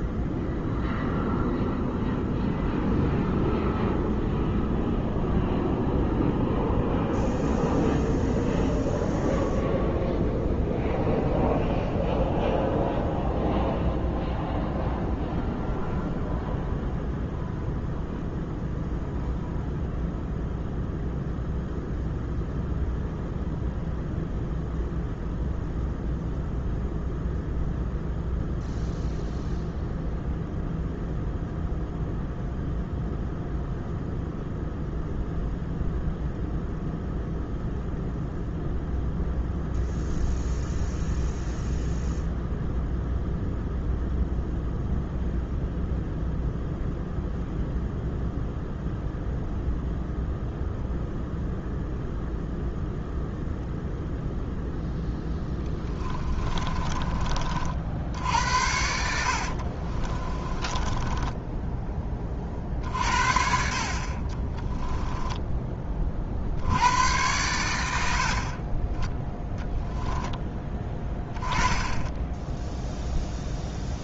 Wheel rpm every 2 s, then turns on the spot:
0, 0, 0, 0, 0, 0, 0, 0, 0, 0, 0, 0, 0, 0, 0, 0, 0, 0, 0, 0, 0, 0, 0, 0, 0, 0, 0, 0, 20, 80, 20, 50, 10, 90, 30, 10, 0.
56-58 60-62 64-66